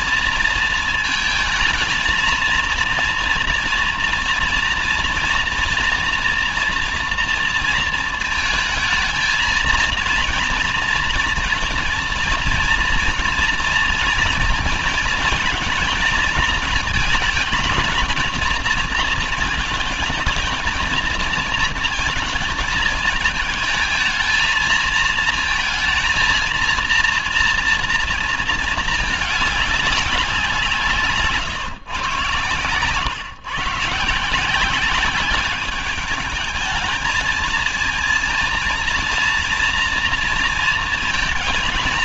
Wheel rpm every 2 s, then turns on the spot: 230, 230, 230, 230, 230, 230, 230, 220, 220, 220, 220, 230, 220, 230, 220, 180, 120, 170, 220, 230, 230.
none